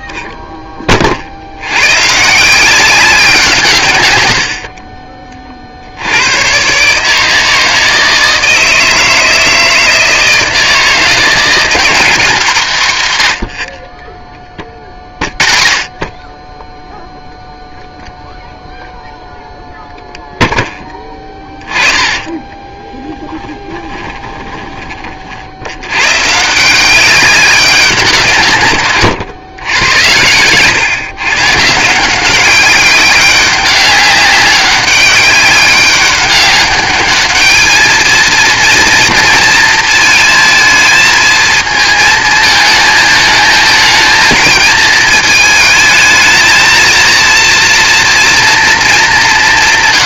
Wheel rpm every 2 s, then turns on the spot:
20, 170, 60, 130, 160, 160, 180, 20, 10, 0, 0, 20, 10, 160, 130, 120, 190, 200, 200, 230, 220, 220, 220, 220, 230.
22-26